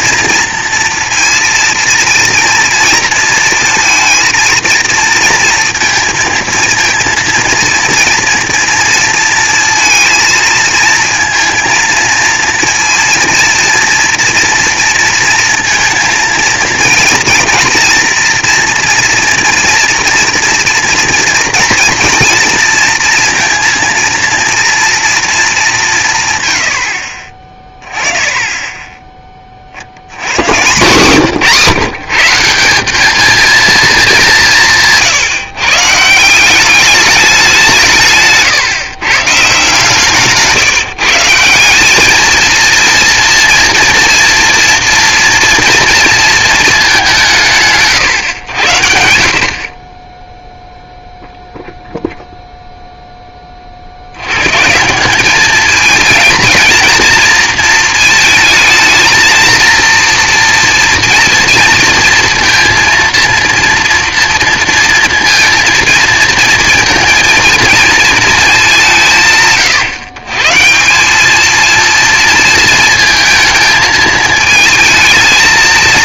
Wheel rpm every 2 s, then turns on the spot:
230, 230, 230, 230, 230, 230, 230, 230, 230, 230, 240, 230, 230, 90, 10, 130, 190, 170, 190, 130, 150, 230, 230, 220, 90, 0, 0, 150, 230, 220, 240, 230, 230, 230, 210, 160, 230, 220.
none